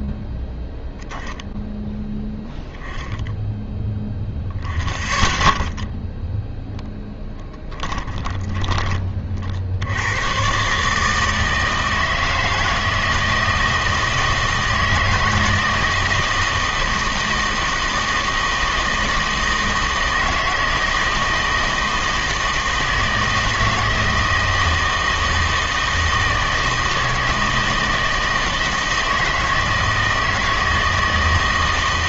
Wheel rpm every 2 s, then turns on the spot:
0, 10, 0, 0, 20, 140, 160, 160, 160, 160, 160, 160, 160, 160, 160, 160.
none